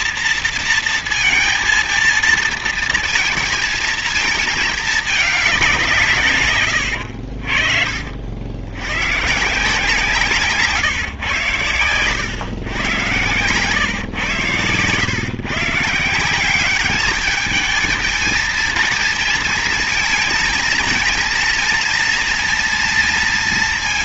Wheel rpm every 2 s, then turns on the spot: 230, 230, 220, 130, 70, 160, 110, 120, 180, 230, 230, 230.
none